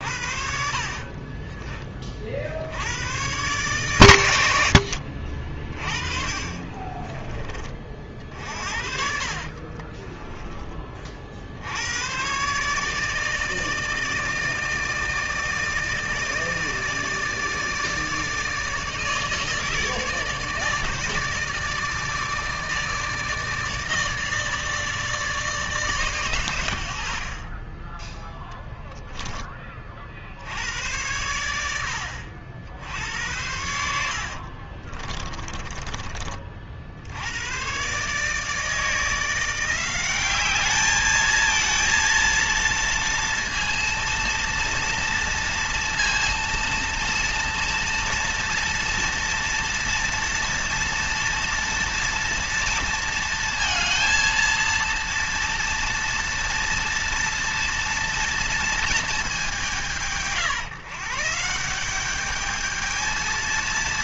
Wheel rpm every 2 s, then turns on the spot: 70, 90, 80, 30, 60, 30, 140, 160, 150, 160, 150, 160, 150, 90, 0, 90, 80, 50, 50, 160, 210, 230, 230, 230, 230, 230, 230, 230, 230, 230, 160, 220.
0-2 6-10 34-36